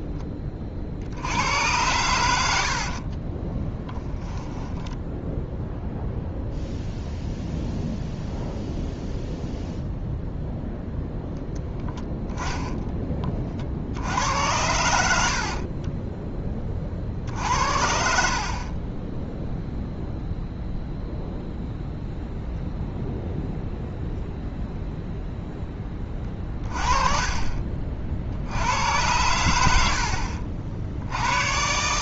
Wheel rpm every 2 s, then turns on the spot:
40, 50, 0, 0, 0, 0, 10, 90, 30, 40, 0, 0, 0, 20, 80, 60.
2-4 18-20